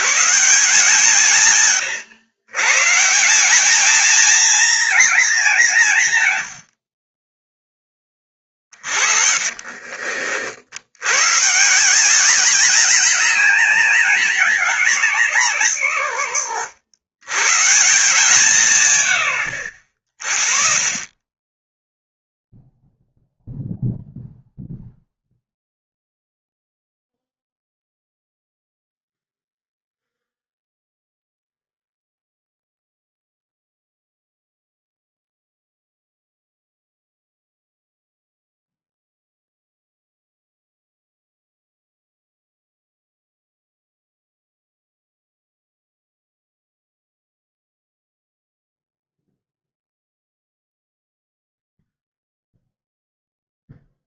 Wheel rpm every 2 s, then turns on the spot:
160, 130, 230, 90, 40, 70, 200, 190, 90, 140, 10, 0, 0, 0, 0, 0, 0, 0, 0, 0, 0, 0, 0, 0, 0, 0, 0.
8-10